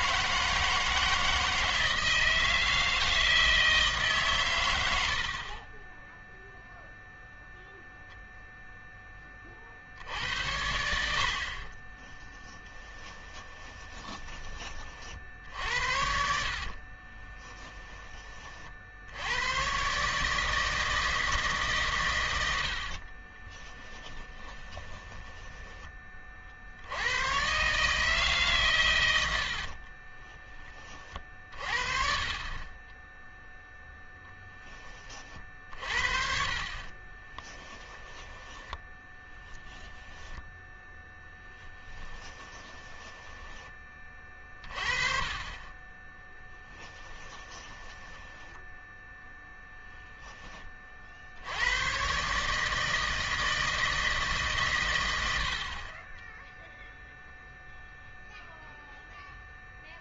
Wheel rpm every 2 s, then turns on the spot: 160, 160, 100, 0, 0, 80, 10, 40, 40, 60, 160, 70, 20, 70, 120, 40, 20, 20, 40, 20, 10, 20, 30, 10, 10, 30, 160, 110, 0, 0.
12-14 16-18 24-26 36-40 42-44 46-50